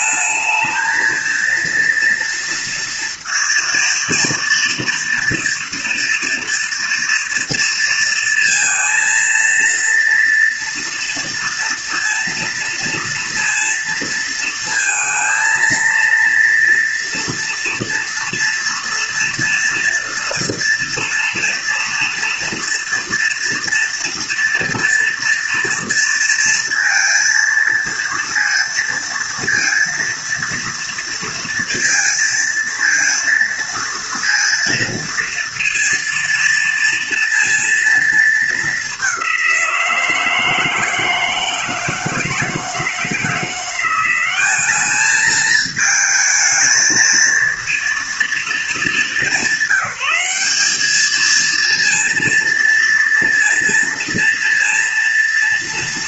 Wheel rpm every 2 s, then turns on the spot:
220, 230, 230, 230, 230, 230, 230, 230, 230, 230, 230, 230, 230, 230, 230, 230, 230, 230, 230, 200, 160, 160, 210, 220, 220, 210, 230, 230.
none